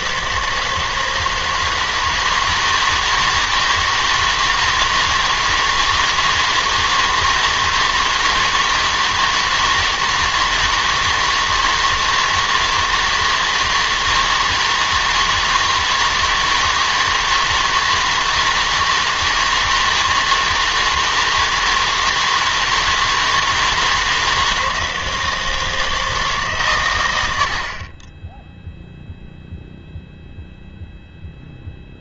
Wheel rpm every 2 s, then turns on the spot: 160, 160, 160, 160, 160, 160, 160, 160, 160, 160, 160, 160, 160, 130, 0, 0.
none